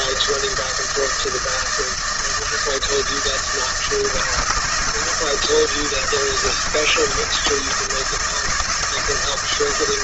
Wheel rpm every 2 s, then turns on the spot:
160, 160, 150, 160, 160.
none